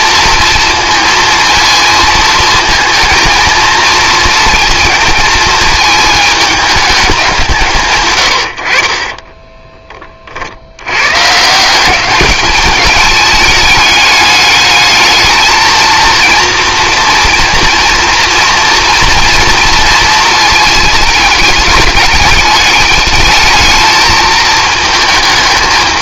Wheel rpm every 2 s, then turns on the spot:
230, 230, 230, 210, 50, 100, 210, 210, 230, 230, 220, 210, 220.
none